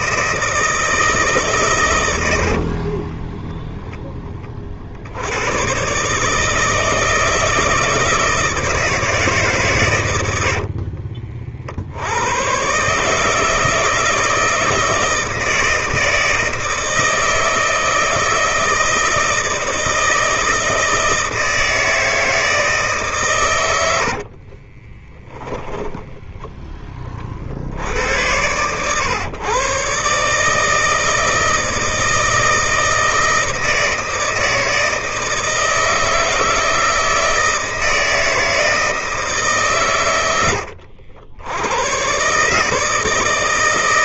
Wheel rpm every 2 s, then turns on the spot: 160, 60, 30, 150, 160, 60, 120, 160, 160, 160, 160, 160, 40, 10, 100, 150, 160, 160, 160, 160, 80, 150.
2-4 10-12 24-26